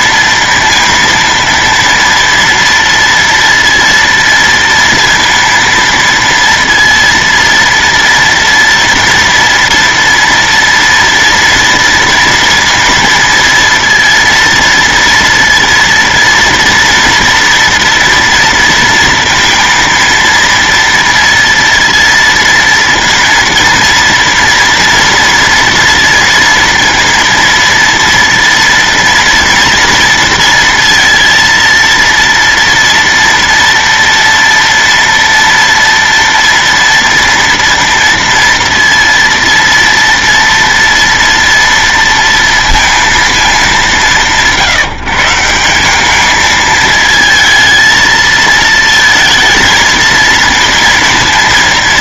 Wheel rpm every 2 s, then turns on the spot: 230, 230, 230, 230, 230, 230, 230, 230, 230, 230, 230, 230, 230, 230, 230, 230, 230, 230, 230, 230, 230, 230, 160, 220, 230, 230.
none